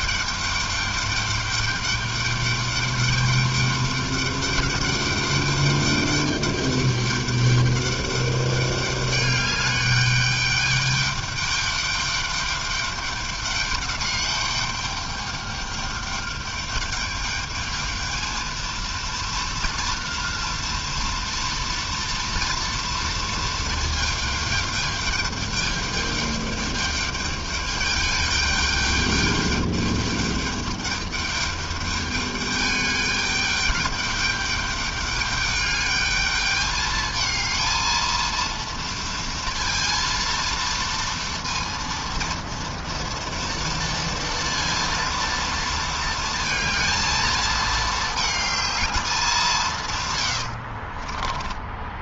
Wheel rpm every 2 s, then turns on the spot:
210, 210, 200, 210, 200, 210, 200, 210, 210, 230, 230, 230, 210, 210, 210, 210, 210, 210, 220, 230, 230, 230, 230, 220, 190, 20.
none